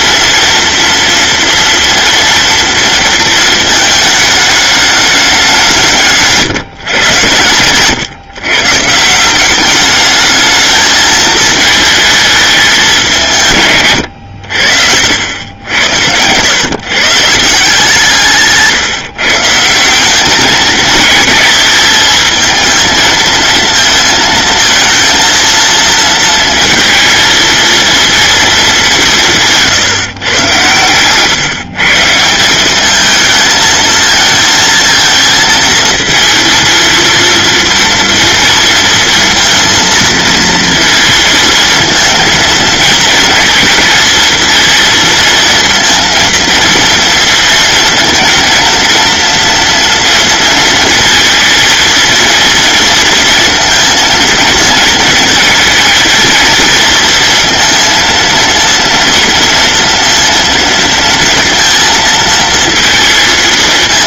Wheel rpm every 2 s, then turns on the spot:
230, 230, 200, 110, 170, 220, 180, 90, 150, 160, 220, 230, 230, 230, 190, 120, 210, 230, 230, 230, 220, 230, 230, 230, 230, 230, 230, 230, 230, 230, 230, 230.
none